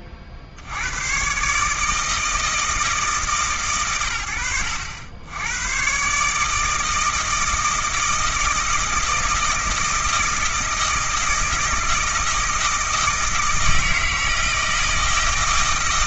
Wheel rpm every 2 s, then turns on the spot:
50, 160, 70, 160, 160, 160, 160, 160.
none